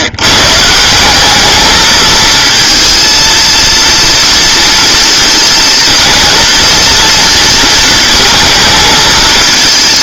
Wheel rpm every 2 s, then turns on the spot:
160, 230, 230, 230, 220.
none